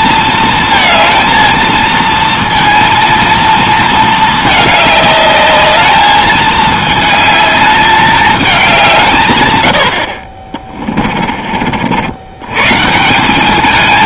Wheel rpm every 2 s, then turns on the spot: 220, 230, 210, 220, 190, 20, 140.
10-12